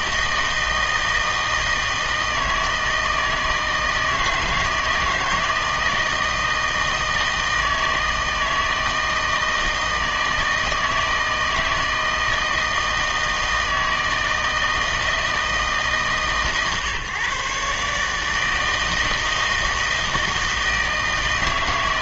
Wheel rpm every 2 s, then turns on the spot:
160, 160, 160, 160, 160, 160, 160, 160, 140, 160, 160.
none